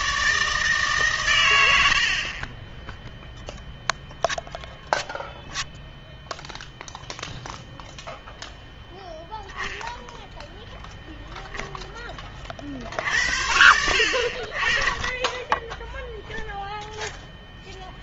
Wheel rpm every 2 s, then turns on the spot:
150, 10, 0, 0, 0, 0, 50, 30, 0.
none